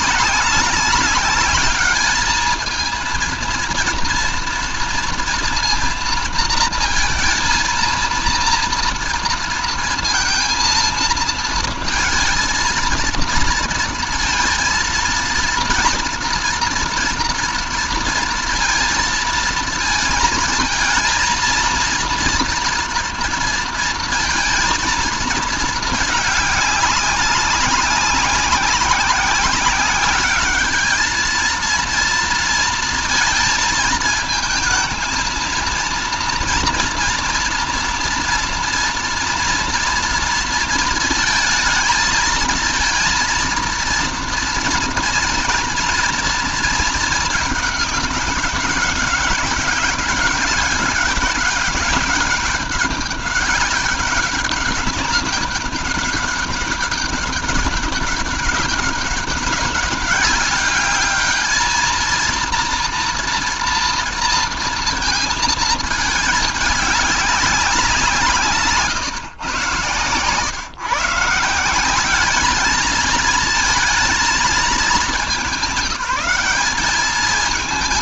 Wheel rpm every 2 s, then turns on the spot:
200, 230, 230, 230, 230, 220, 230, 230, 230, 230, 220, 230, 230, 200, 190, 220, 230, 230, 230, 230, 230, 230, 230, 220, 200, 200, 200, 200, 200, 200, 210, 230, 230, 200, 140, 150, 220, 210, 210.
none